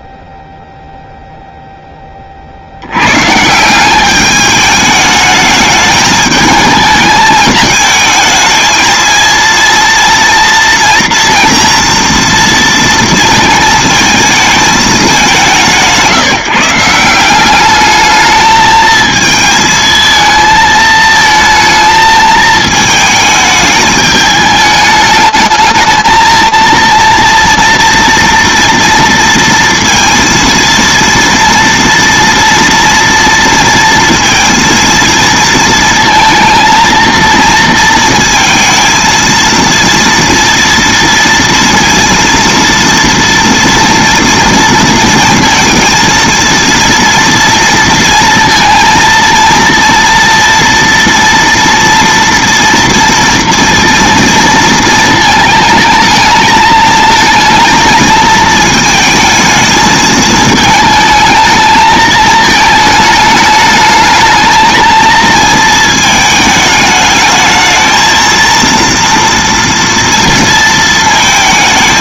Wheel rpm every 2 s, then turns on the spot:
0, 10, 190, 220, 220, 230, 240, 220, 170, 210, 220, 220, 210, 220, 240, 230, 230, 230, 220, 230, 230, 230, 230, 230, 230, 230, 240, 230, 220, 220, 220, 220, 220, 220, 230, 230.
none